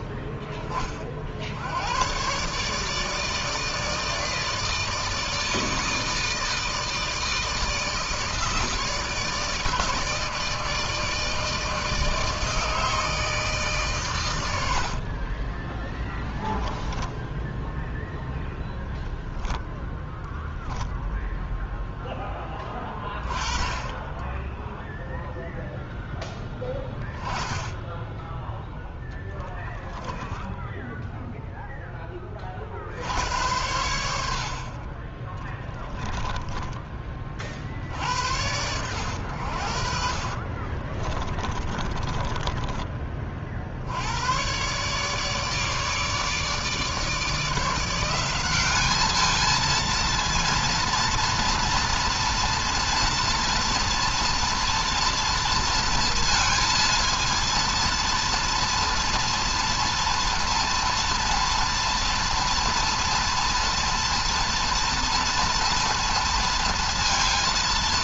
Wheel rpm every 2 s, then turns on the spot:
20, 150, 160, 160, 160, 160, 160, 70, 10, 0, 0, 20, 10, 20, 10, 10, 50, 60, 20, 90, 40, 20, 140, 150, 200, 230, 230, 230, 230, 230, 230, 240, 240, 230.
14-18 30-32 40-44